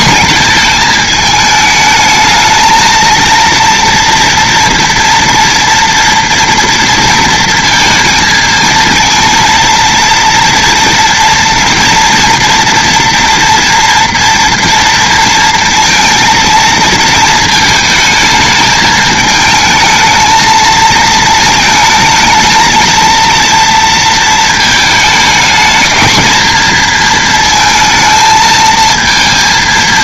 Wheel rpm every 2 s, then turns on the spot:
220, 230, 230, 230, 230, 230, 230, 230, 230, 220, 230, 230, 220, 230, 230.
none